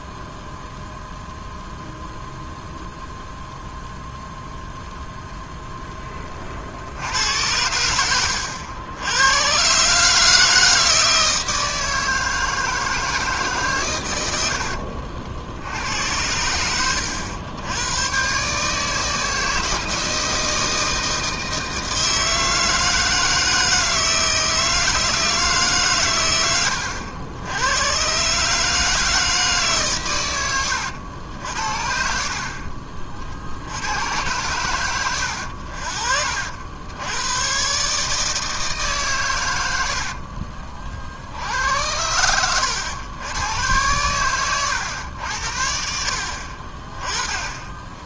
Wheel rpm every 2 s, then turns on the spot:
0, 0, 0, 60, 90, 160, 160, 60, 90, 160, 160, 160, 160, 100, 160, 90, 40, 100, 80, 140, 40, 100, 100, 30.
14-16